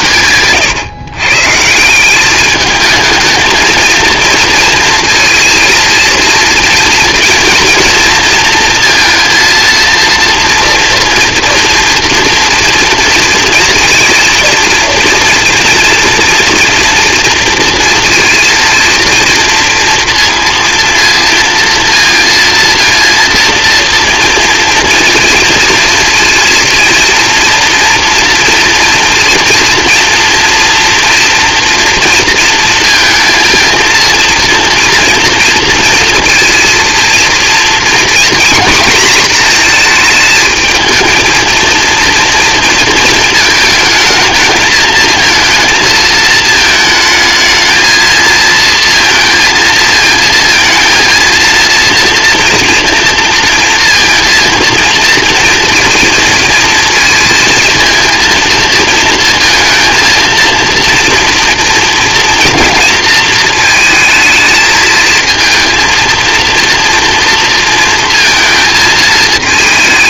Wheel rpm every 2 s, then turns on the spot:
140, 210, 230, 230, 230, 230, 230, 230, 230, 230, 230, 230, 230, 230, 230, 230, 230, 230, 230, 240, 220, 230, 220, 220, 230, 230, 230, 230, 230, 230, 230, 230, 220, 230, 220.
none